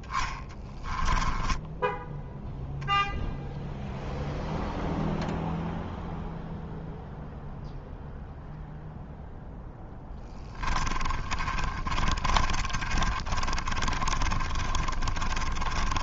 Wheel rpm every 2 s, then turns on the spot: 10, 0, 0, 0, 0, 20, 40, 30.
0-2 10-16